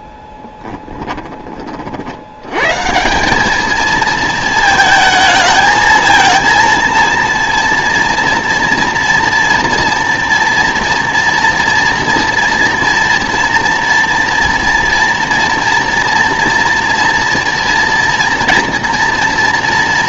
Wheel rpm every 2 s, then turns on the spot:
10, 120, 220, 230, 240, 240, 230, 230, 230, 230.
none